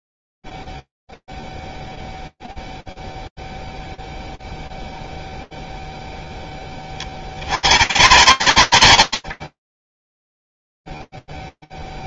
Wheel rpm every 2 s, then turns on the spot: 0, 0, 0, 10, 100, 0.
none